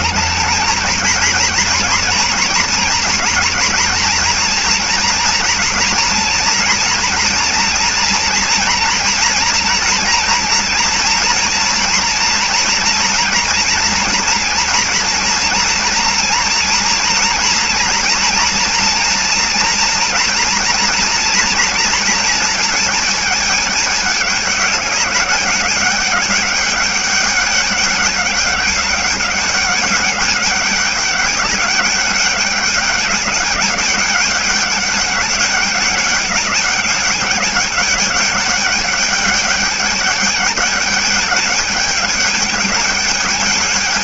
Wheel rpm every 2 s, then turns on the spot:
220, 230, 240, 230, 230, 230, 240, 230, 240, 230, 230, 230, 210, 200, 200, 200, 200, 200, 200, 200, 210, 210.
none